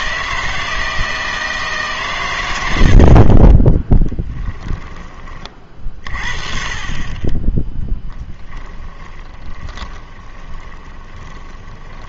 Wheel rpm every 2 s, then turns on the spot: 160, 80, 10, 30, 10, 20.
4-6 8-12